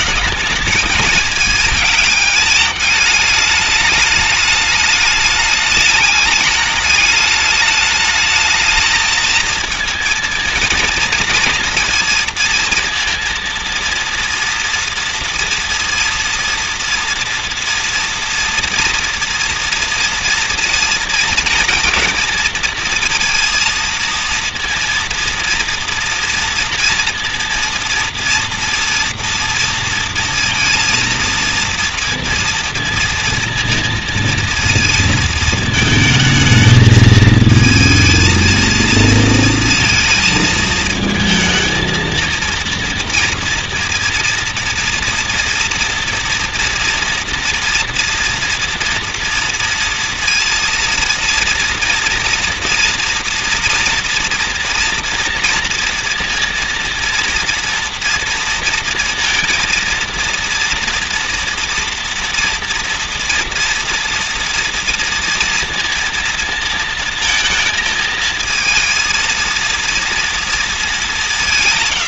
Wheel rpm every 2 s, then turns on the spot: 220, 210, 210, 210, 220, 230, 230, 230, 230, 230, 230, 220, 230, 230, 230, 230, 230, 230, 220, 220, 220, 230, 230, 230, 230, 230, 230, 230, 230, 230, 230, 230, 230, 230, 230, 220.
none